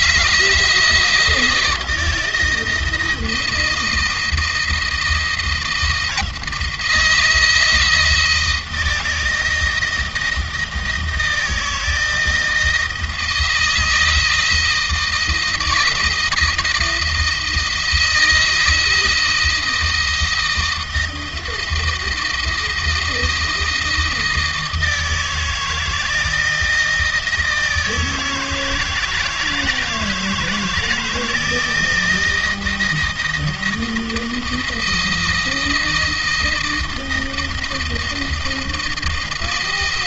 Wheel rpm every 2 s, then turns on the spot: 160, 160, 160, 160, 160, 160, 160, 160, 170, 160, 160, 170, 160, 170, 160, 160, 160, 170, 160, 160.
none